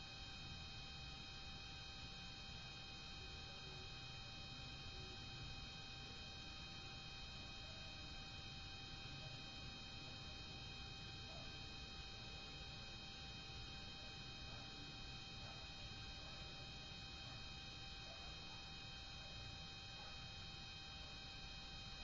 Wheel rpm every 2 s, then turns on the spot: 0, 0, 0, 0, 0, 0, 0, 0, 0, 0, 0.
none